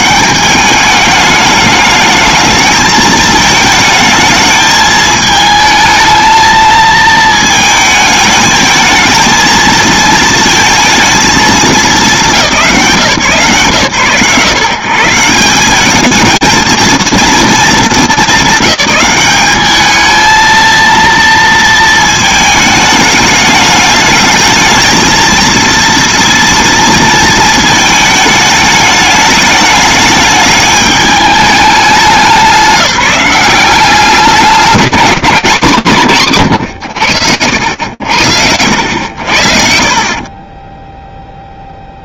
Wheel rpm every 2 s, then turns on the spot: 210, 220, 220, 220, 220, 230, 170, 130, 230, 200, 230, 210, 220, 230, 210, 210, 180, 190, 80, 60, 0.
none